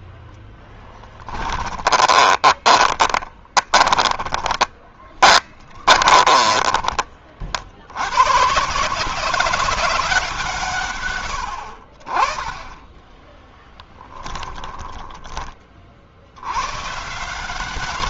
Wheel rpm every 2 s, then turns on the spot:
0, 20, 20, 20, 130, 160, 30, 20, 90.
2-8 14-16